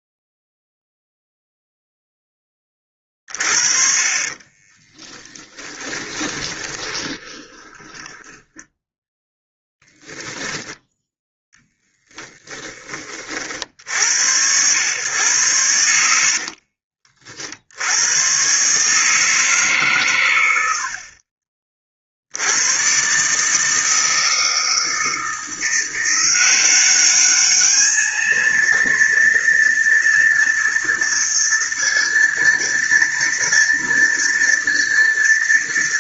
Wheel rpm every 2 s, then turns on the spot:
0, 10, 20, 20, 10, 10, 20, 90, 60, 120, 90, 80, 160, 180, 230, 230, 230, 230.
4-10 12-14 16-18